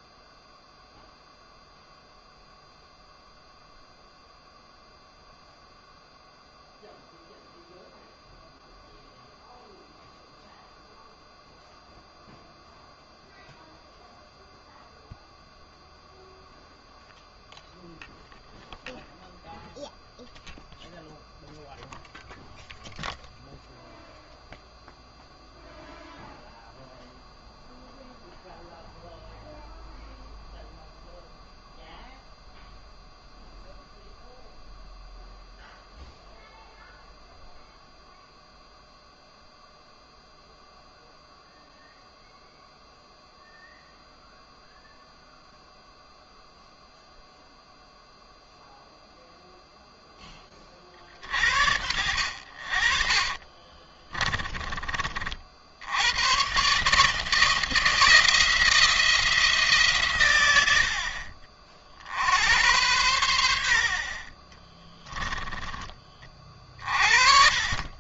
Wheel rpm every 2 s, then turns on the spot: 0, 0, 0, 0, 0, 0, 0, 0, 0, 0, 0, 0, 0, 0, 0, 0, 0, 0, 0, 0, 0, 0, 0, 0, 0, 40, 50, 30, 140, 170, 70, 90, 20, 40.
64-66